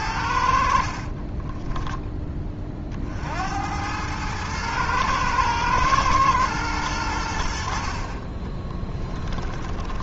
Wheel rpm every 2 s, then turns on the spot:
60, 40, 110, 100, 10.
8-10